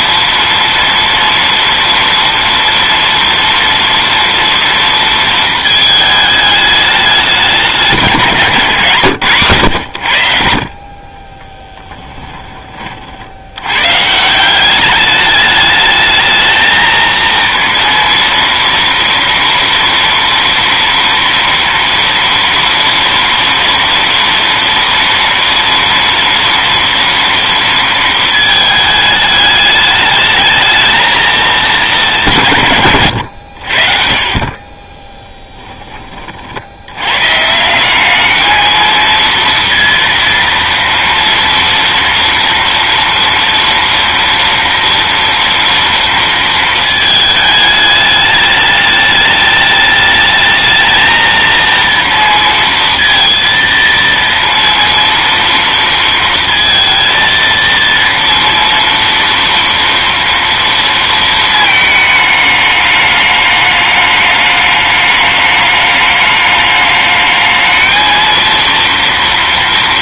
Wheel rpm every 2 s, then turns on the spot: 230, 230, 230, 210, 140, 40, 30, 200, 220, 230, 230, 230, 230, 230, 220, 220, 140, 30, 90, 220, 230, 230, 240, 230, 210, 220, 230, 230, 230, 230, 230, 210, 210, 210, 230.
34-36